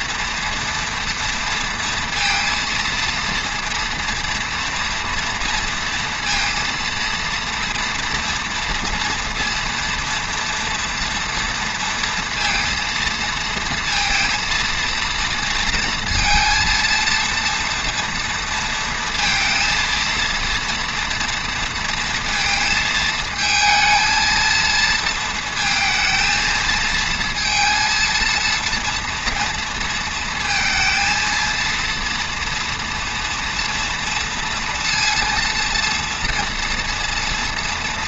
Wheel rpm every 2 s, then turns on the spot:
230, 230, 230, 230, 230, 230, 230, 230, 230, 230, 230, 220, 230, 220, 230, 230, 230, 240, 230.
none